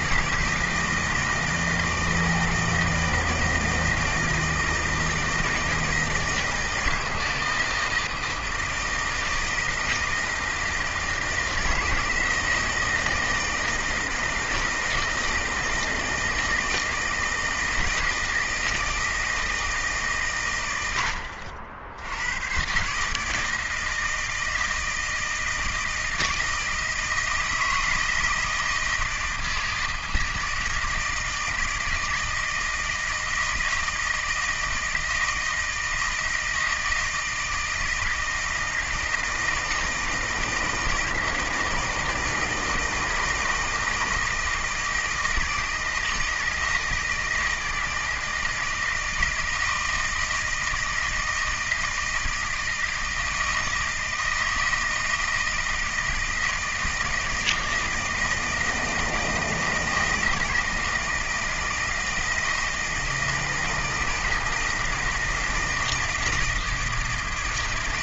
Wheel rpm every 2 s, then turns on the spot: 160, 160, 160, 160, 160, 160, 160, 160, 160, 160, 100, 130, 160, 160, 160, 160, 160, 160, 160, 160, 160, 160, 160, 160, 160, 160, 160, 160, 160, 160, 160, 160, 160, 160.
none